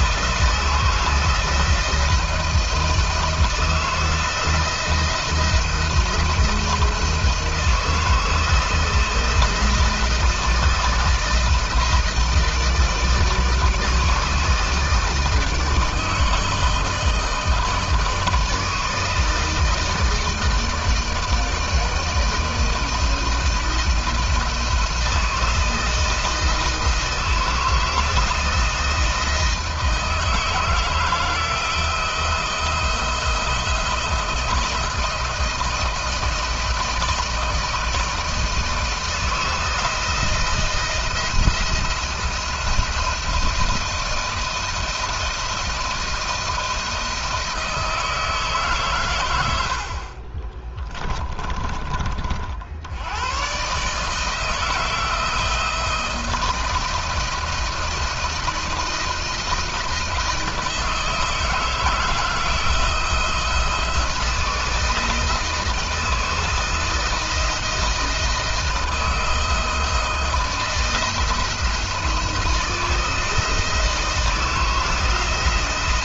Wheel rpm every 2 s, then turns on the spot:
170, 160, 160, 160, 160, 160, 150, 160, 160, 160, 160, 160, 160, 160, 160, 160, 170, 160, 160, 160, 170, 170, 170, 160, 130, 20, 80, 160, 170, 160, 160, 160, 160, 160, 160, 170, 160, 160.
50-52